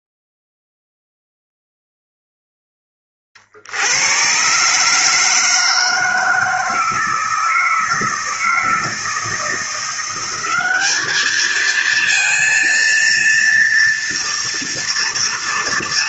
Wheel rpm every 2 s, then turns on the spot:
0, 10, 140, 160, 160, 200, 230, 230.
none